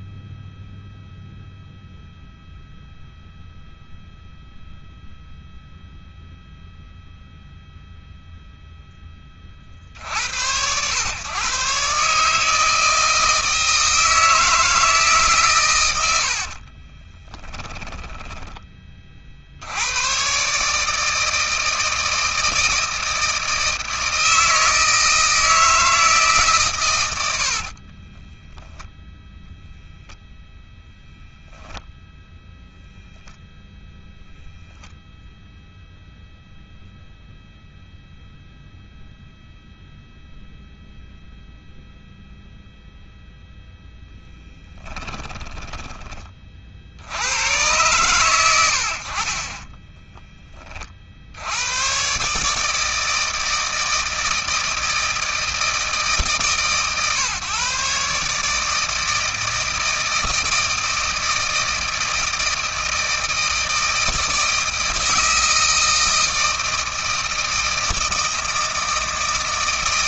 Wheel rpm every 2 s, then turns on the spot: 0, 0, 0, 0, 20, 110, 160, 160, 40, 40, 150, 160, 160, 110, 0, 0, 0, 0, 0, 0, 0, 0, 10, 80, 70, 50, 160, 160, 130, 160, 160, 160, 160, 160, 160.
16-18 44-46